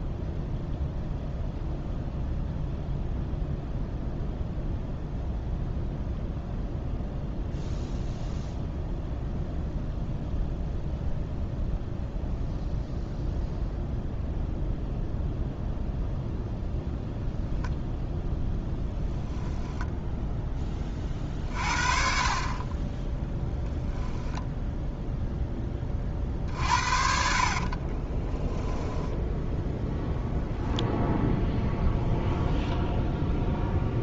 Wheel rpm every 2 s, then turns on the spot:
0, 0, 0, 0, 0, 0, 0, 0, 0, 20, 20, 30, 0, 50, 10, 0, 0.
18-20 26-30